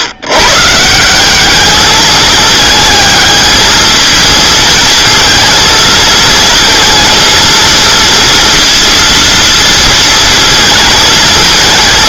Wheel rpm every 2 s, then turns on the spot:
140, 220, 230, 230, 230, 230.
none